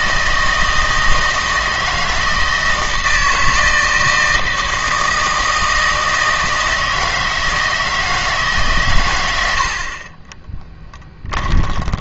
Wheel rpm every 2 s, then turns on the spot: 160, 160, 160, 160, 130, 10.
10-12